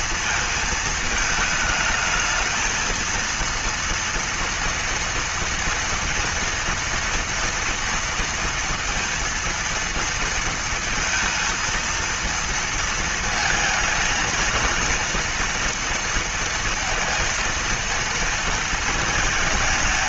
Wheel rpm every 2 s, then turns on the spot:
230, 220, 230, 230, 230, 230, 230, 230, 230, 220.
none